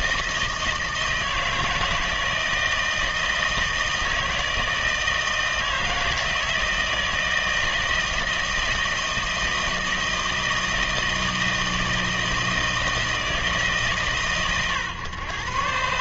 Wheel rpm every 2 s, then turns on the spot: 160, 160, 160, 160, 160, 160, 160, 120.
none